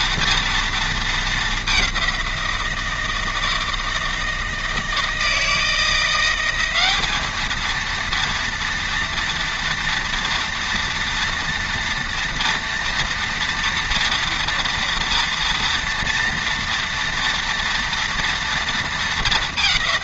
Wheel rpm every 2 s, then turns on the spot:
220, 160, 160, 210, 230, 230, 230, 230, 230, 220.
none